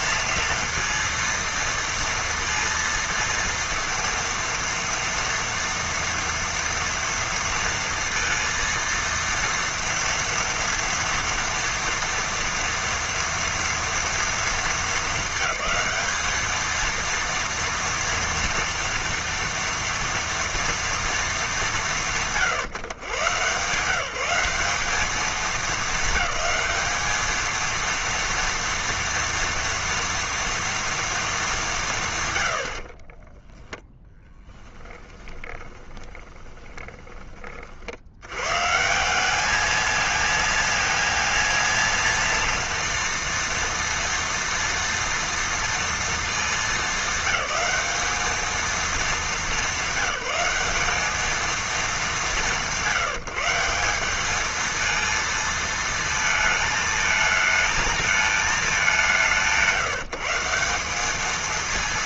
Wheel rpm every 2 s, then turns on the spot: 230, 230, 230, 230, 230, 230, 230, 220, 220, 230, 230, 130, 200, 210, 230, 230, 80, 10, 20, 130, 230, 230, 230, 210, 220, 200, 170, 220, 220, 210, 170.
34-38